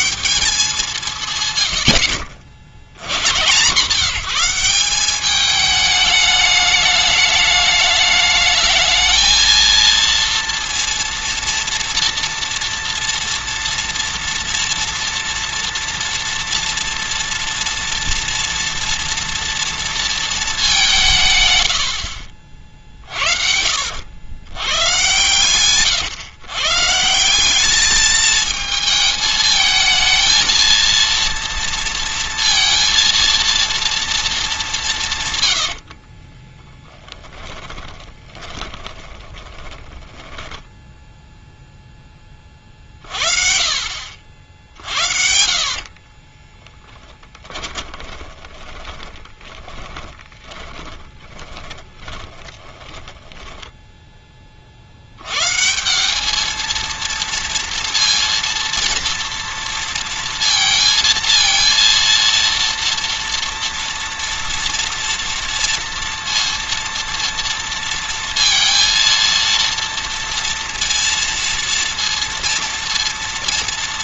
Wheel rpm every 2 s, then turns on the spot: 190, 80, 190, 210, 220, 230, 230, 230, 230, 230, 190, 50, 120, 150, 220, 230, 230, 180, 10, 20, 10, 50, 60, 10, 20, 20, 20, 50, 230, 230, 230, 240, 240, 230, 230, 230, 230.
22-24 36-40 46-54